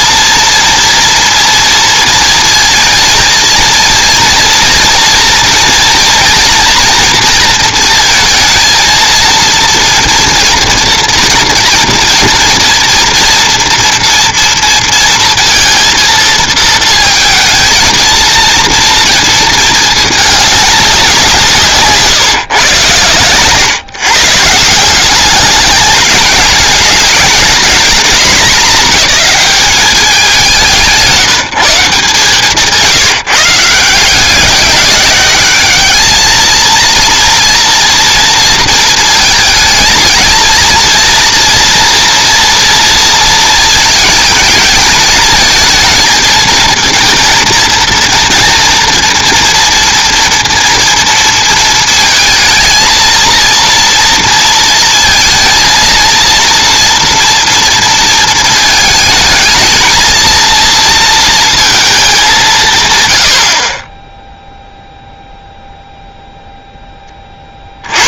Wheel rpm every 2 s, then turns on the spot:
230, 230, 230, 230, 230, 230, 230, 230, 230, 230, 210, 130, 160, 210, 220, 180, 160, 190, 220, 230, 230, 230, 220, 220, 230, 230, 220, 230, 230, 220, 230, 170, 0, 0.
none